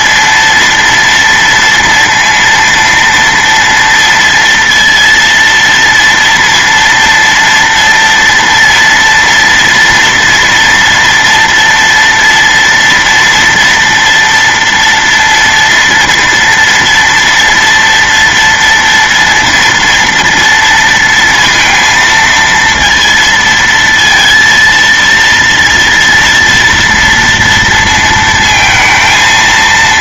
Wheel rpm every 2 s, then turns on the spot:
230, 230, 230, 230, 230, 240, 230, 230, 230, 230, 230, 230, 230, 230, 220.
none